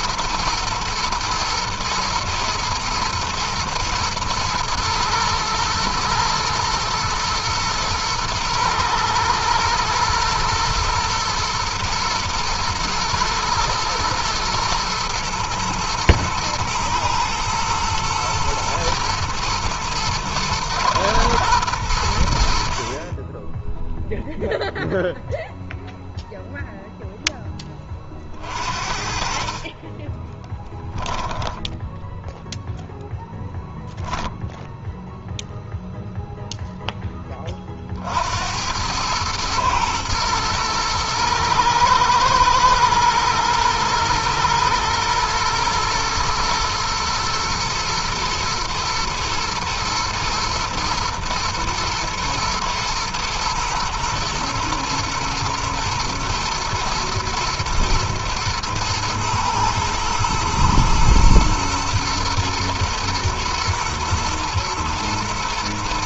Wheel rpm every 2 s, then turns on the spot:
110, 120, 110, 120, 110, 120, 120, 110, 120, 120, 110, 20, 0, 0, 50, 10, 0, 0, 10, 100, 110, 110, 120, 110, 110, 120, 110, 120, 120, 110, 120, 120, 110.
30-32